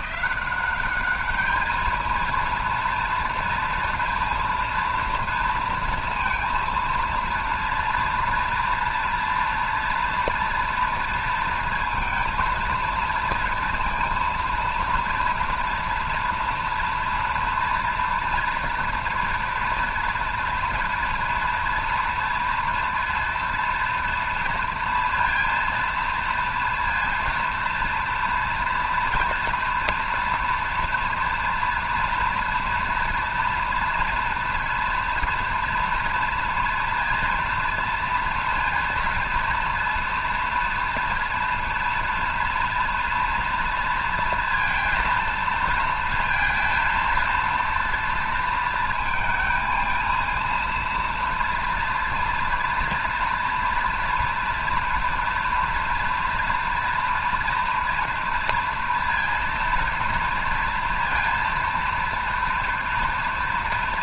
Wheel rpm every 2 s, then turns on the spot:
200, 230, 230, 230, 230, 230, 230, 230, 240, 240, 230, 230, 230, 240, 240, 230, 230, 230, 230, 230, 230, 230, 230, 230, 220, 230, 230, 230, 230, 230, 230, 230.
none